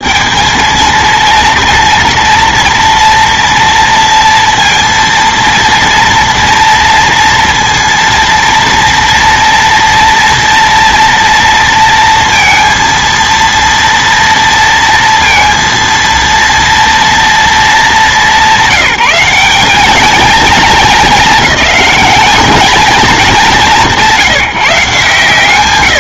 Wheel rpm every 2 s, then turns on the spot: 220, 230, 230, 230, 230, 230, 230, 230, 230, 180, 220, 210, 150.
none